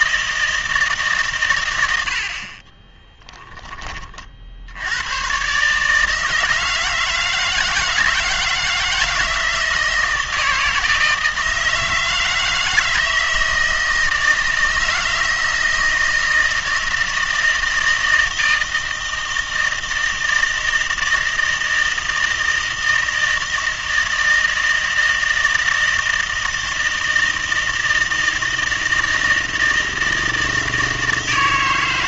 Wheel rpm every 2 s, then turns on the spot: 160, 30, 70, 160, 160, 160, 160, 160, 160, 160, 160, 160, 160, 160, 160, 160.
2-4